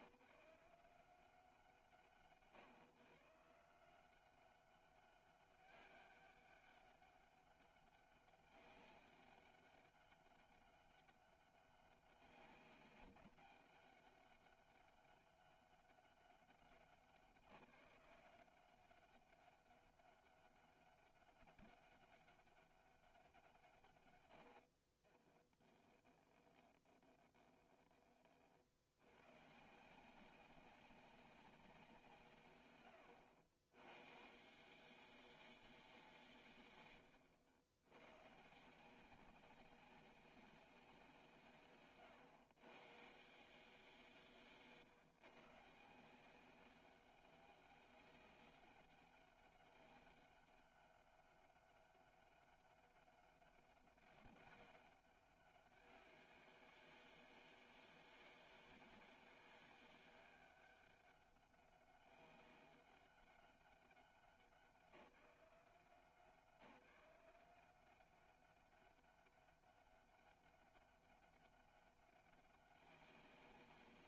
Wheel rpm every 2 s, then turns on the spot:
180, 120, 190, 200, 200, 200, 200, 200, 190, 180, 200, 200, 70, 20, 60, 190, 100, 160, 130, 150, 190, 120, 130, 190, 200, 200, 200, 200, 190, 190, 200, 200, 190, 180, 190, 200, 190.
24-28 44-46